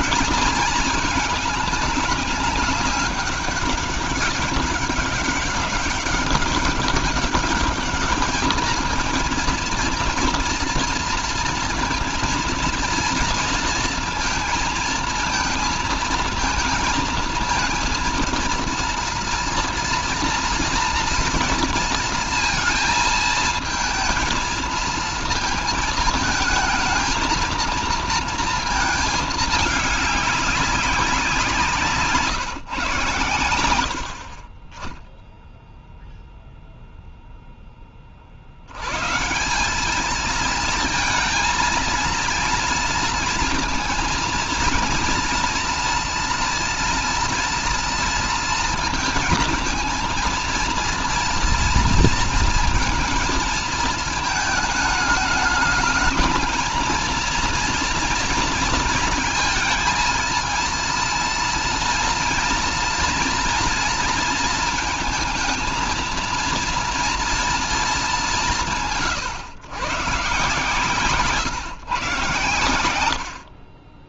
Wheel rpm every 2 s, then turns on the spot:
220, 200, 190, 200, 220, 230, 230, 230, 230, 230, 230, 230, 230, 220, 220, 200, 150, 20, 0, 120, 220, 230, 230, 230, 230, 230, 230, 220, 220, 230, 230, 230, 230, 230, 150, 150, 90.
none